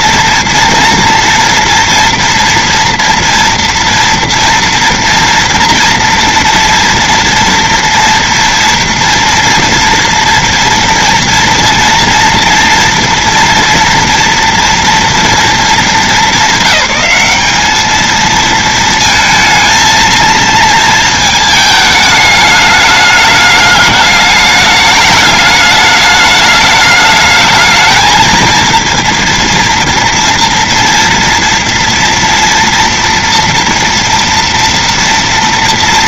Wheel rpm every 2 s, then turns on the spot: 230, 230, 230, 230, 240, 230, 230, 230, 210, 220, 230, 210, 210, 210, 220, 240, 240, 230.
none